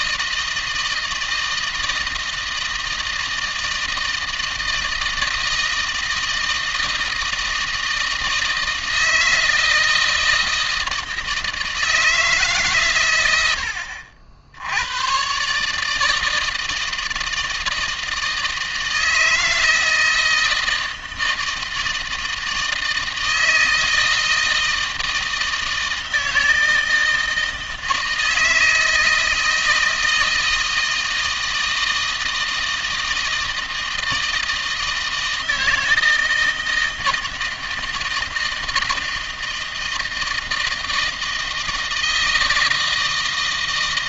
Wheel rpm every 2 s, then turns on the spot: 160, 160, 160, 160, 160, 160, 130, 100, 160, 160, 160, 160, 160, 160, 160, 160, 160, 160, 160, 160, 160, 160.
none